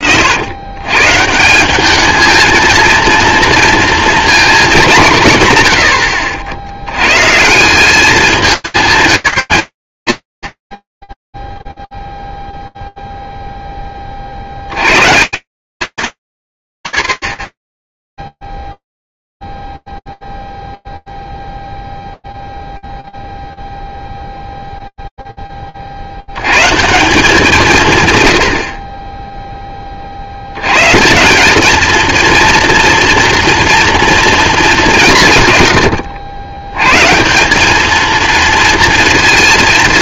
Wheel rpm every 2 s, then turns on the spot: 160, 230, 150, 120, 190, 20, 0, 100, 70, 0, 0, 0, 0, 170, 30, 140, 230, 190, 120, 230.
none